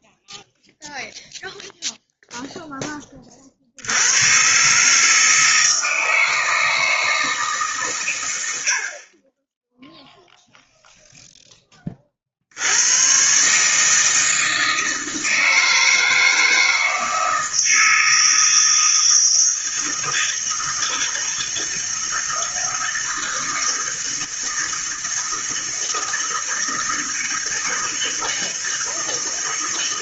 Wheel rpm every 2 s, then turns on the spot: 0, 10, 140, 160, 60, 0, 80, 160, 160, 160, 160, 160, 160, 160, 160.
none